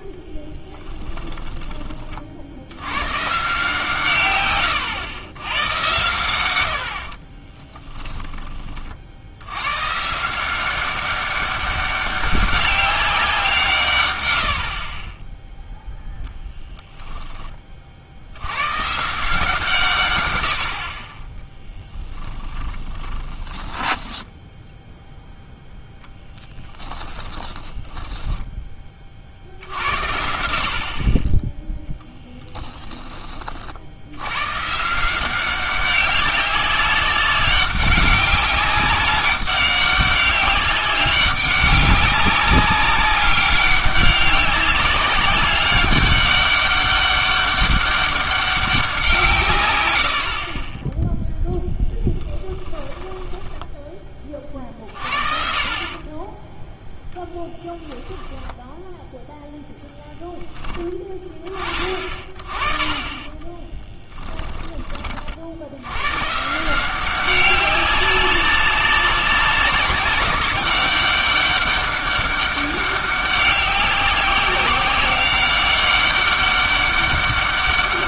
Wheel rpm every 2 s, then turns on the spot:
20, 80, 110, 90, 30, 190, 200, 50, 10, 100, 70, 20, 0, 10, 10, 60, 10, 130, 190, 200, 200, 200, 200, 200, 190, 20, 10, 40, 10, 0, 20, 20, 30, 170, 190, 190, 200, 190, 200.
0-2 4-6 22-24 26-28 52-54 64-66